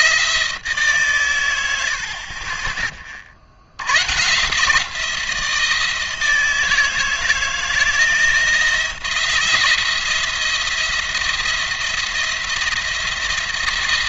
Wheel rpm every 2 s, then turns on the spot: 150, 30, 140, 160, 170, 170, 170.
none